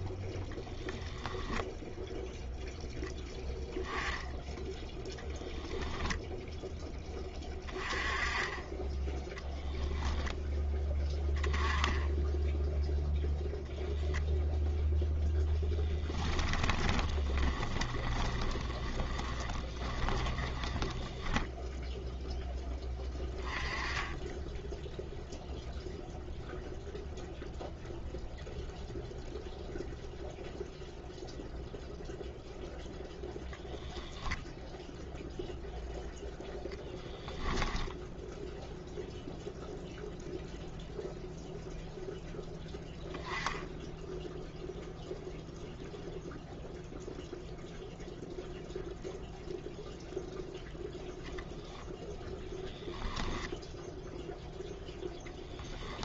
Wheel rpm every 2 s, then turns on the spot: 10, 0, 10, 10, 10, 10, 0, 0, 20, 20, 10, 10, 0, 0, 0, 0, 0, 0, 10, 0, 0, 10, 0, 0, 0, 0, 10, 0.
16-22